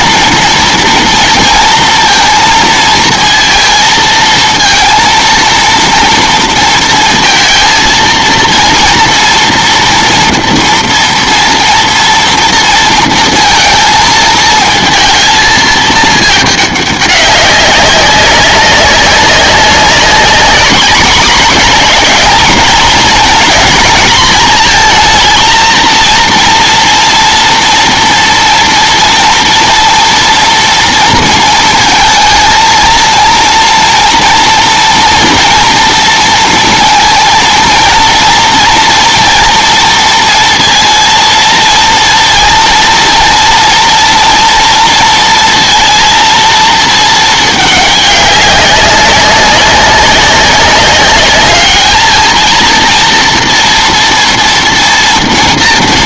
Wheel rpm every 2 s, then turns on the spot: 230, 230, 230, 230, 230, 230, 230, 220, 200, 190, 200, 230, 230, 230, 230, 230, 230, 230, 230, 230, 230, 230, 230, 230, 190, 200, 230, 230.
none